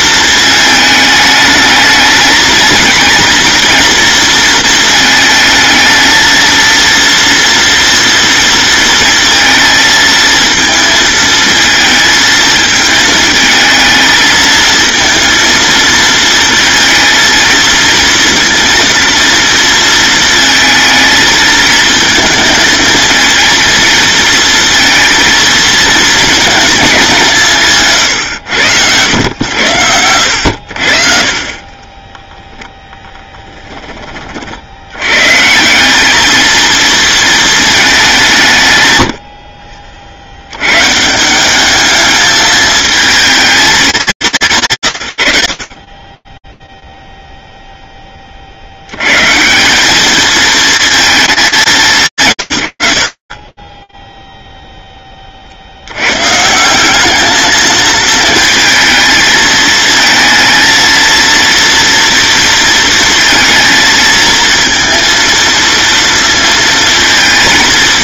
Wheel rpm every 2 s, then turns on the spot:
220, 230, 220, 230, 230, 230, 220, 230, 230, 230, 220, 220, 230, 200, 100, 70, 10, 100, 220, 100, 150, 220, 110, 0, 110, 230, 120, 0, 170, 220, 220, 230, 230, 220.
none